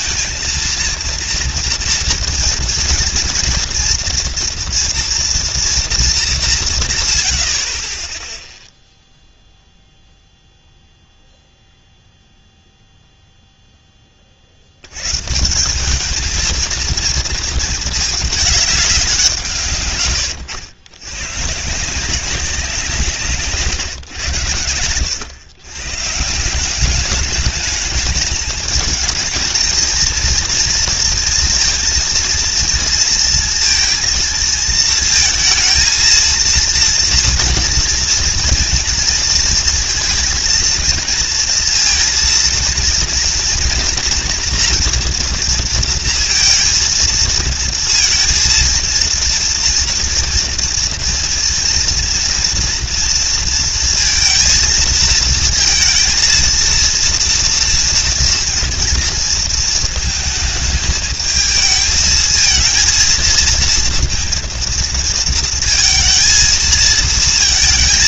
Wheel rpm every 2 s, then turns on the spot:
230, 240, 230, 170, 0, 0, 0, 80, 230, 200, 110, 180, 100, 180, 220, 230, 230, 230, 230, 230, 230, 230, 240, 230, 230, 230, 230, 230, 230, 230, 220, 220, 230, 230.
none